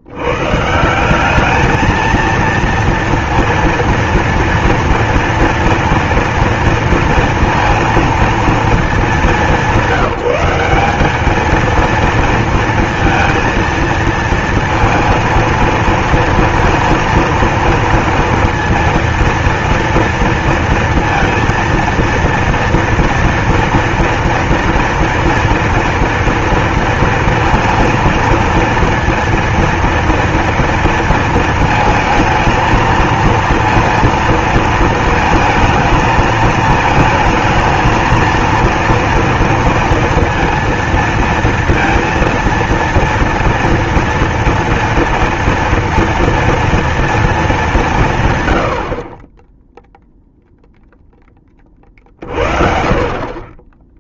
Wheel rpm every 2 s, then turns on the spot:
130, 230, 230, 230, 220, 190, 230, 230, 230, 230, 230, 230, 230, 230, 230, 230, 230, 230, 220, 230, 230, 230, 230, 230, 130, 0, 40.
none